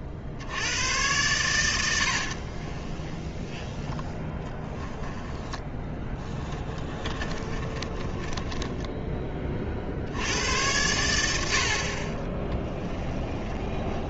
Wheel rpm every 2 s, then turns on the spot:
70, 50, 10, 10, 10, 90, 10.
2-10 12-14